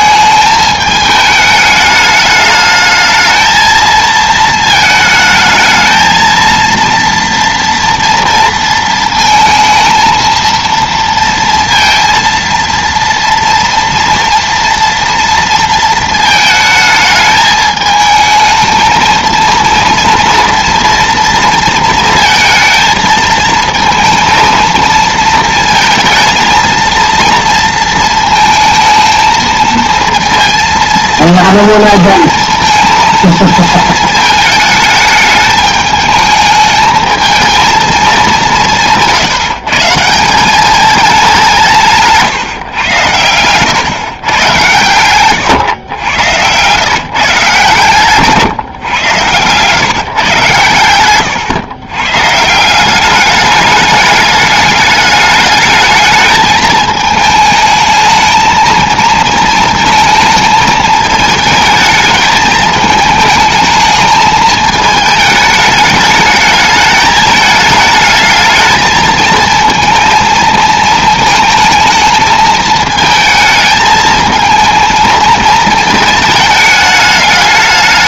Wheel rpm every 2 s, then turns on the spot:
220, 220, 220, 230, 230, 230, 230, 230, 220, 220, 230, 230, 230, 230, 220, 230, 230, 220, 220, 180, 200, 130, 110, 110, 140, 120, 170, 210, 220, 220, 220, 220, 220, 210, 220, 220, 220, 220, 220.
none